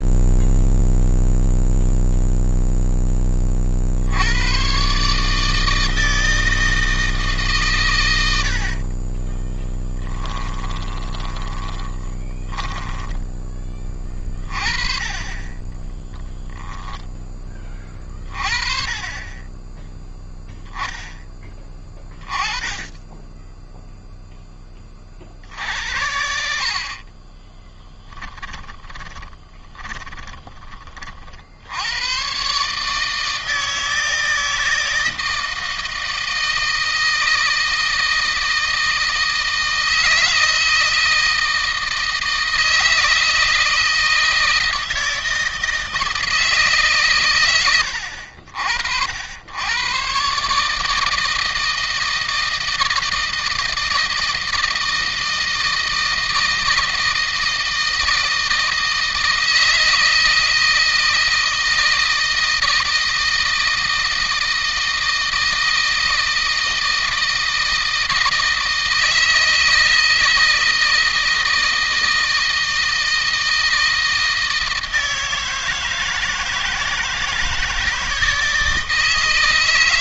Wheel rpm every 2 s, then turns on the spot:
0, 0, 110, 160, 70, 20, 20, 30, 10, 30, 0, 20, 10, 60, 10, 30, 140, 160, 160, 160, 160, 160, 160, 150, 60, 150, 160, 160, 160, 160, 160, 160, 160, 160, 160, 160, 160, 160, 160, 160.
8-14 16-18 26-30